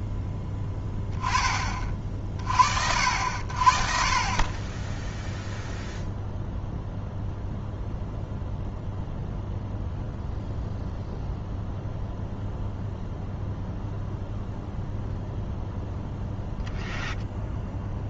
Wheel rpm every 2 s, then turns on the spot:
10, 50, 0, 0, 0, 0, 0, 0, 0.
none